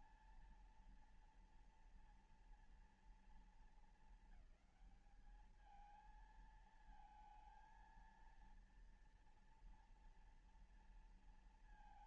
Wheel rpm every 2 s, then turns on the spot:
230, 230, 210, 220, 230, 230.
none